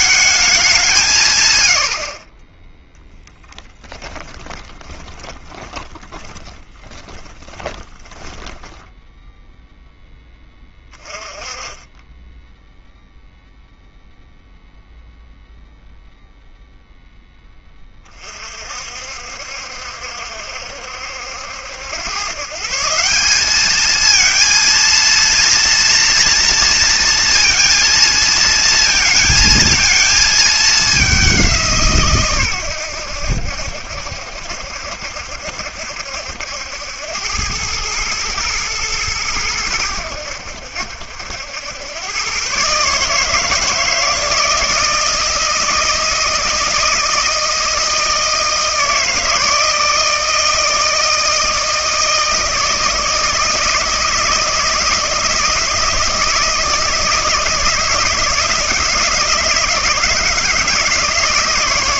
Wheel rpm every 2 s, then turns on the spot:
190, 10, 20, 10, 10, 20, 0, 0, 0, 50, 70, 160, 230, 230, 220, 210, 100, 70, 80, 110, 80, 130, 160, 160, 160, 160, 160, 170, 160, 160, 160.
4-8